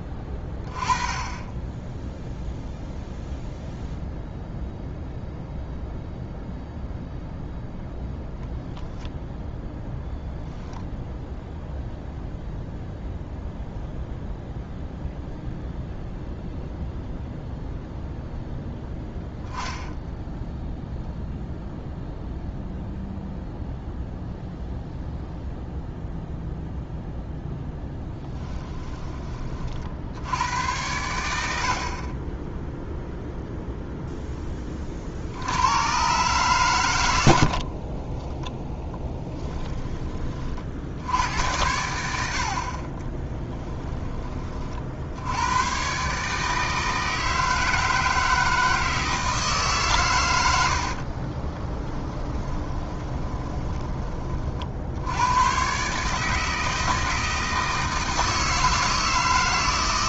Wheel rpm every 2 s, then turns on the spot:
20, 0, 0, 0, 0, 0, 0, 0, 0, 0, 0, 0, 0, 0, 20, 100, 0, 40, 110, 10, 70, 30, 50, 160, 160, 60, 20, 70, 160, 160.
38-40 42-44 50-54